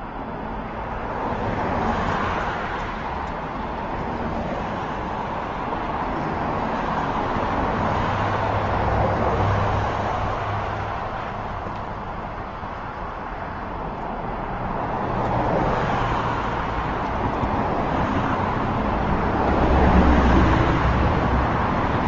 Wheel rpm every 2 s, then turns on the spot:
0, 0, 0, 0, 0, 0, 0, 0, 0, 0, 0.
none